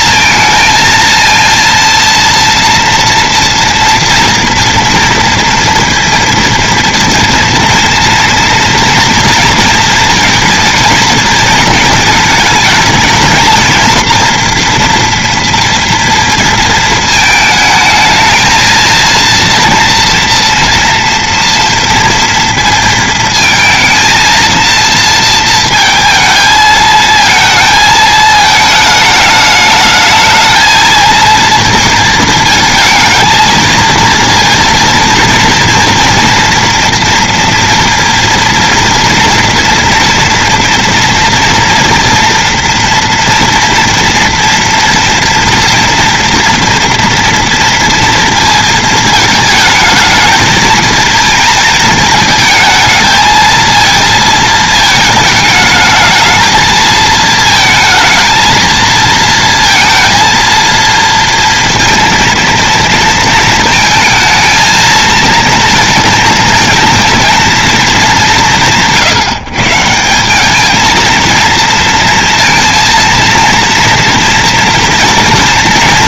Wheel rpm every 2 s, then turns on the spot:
220, 230, 230, 230, 230, 230, 230, 230, 230, 230, 230, 230, 230, 220, 220, 220, 220, 240, 240, 230, 230, 230, 230, 230, 230, 220, 220, 220, 220, 230, 230, 230, 220, 230, 150, 210, 230, 230.
none